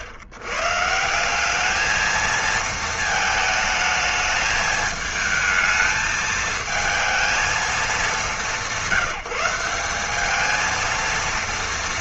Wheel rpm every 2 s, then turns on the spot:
110, 230, 220, 220, 170, 220.
none